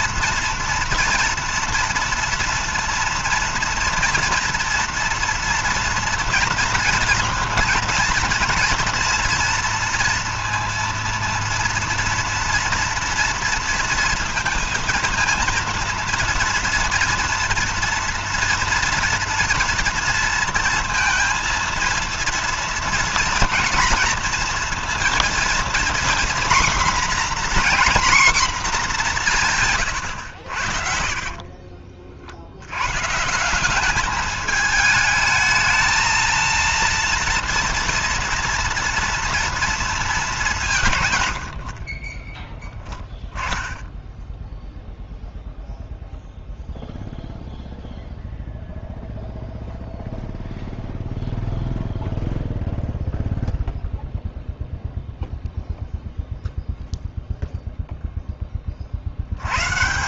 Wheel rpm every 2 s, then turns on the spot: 230, 230, 230, 230, 230, 230, 230, 230, 230, 230, 230, 230, 230, 250, 240, 90, 60, 210, 230, 230, 200, 10, 10, 0, 0, 0, 0, 0, 0, 20.
42-44